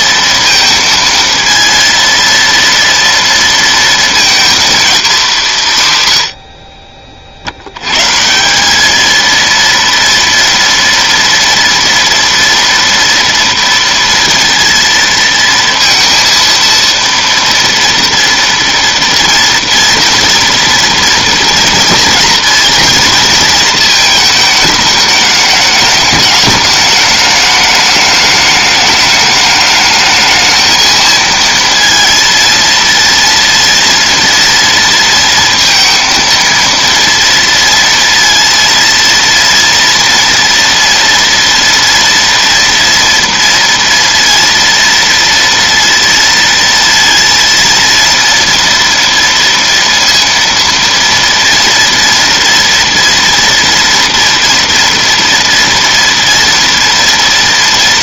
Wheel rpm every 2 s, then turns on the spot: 230, 230, 230, 40, 210, 230, 230, 230, 230, 230, 240, 230, 220, 210, 210, 220, 230, 230, 230, 230, 240, 230, 230, 230, 230, 230, 230, 230, 230.
none